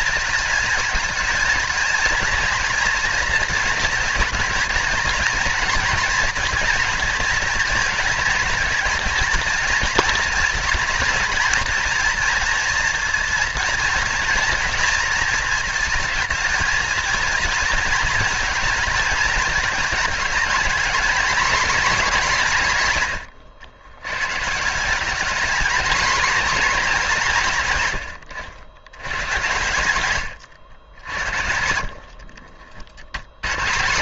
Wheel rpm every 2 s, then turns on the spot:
220, 230, 220, 230, 230, 230, 230, 230, 230, 230, 230, 170, 160, 220, 90, 90, 50.
30-32